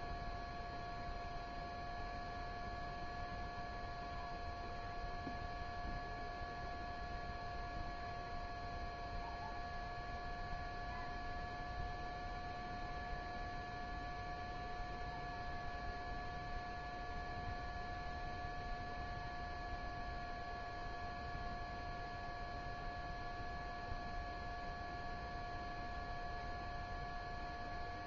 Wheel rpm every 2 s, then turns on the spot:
0, 0, 0, 0, 0, 0, 0, 0, 0, 0, 0, 0, 0, 0.
none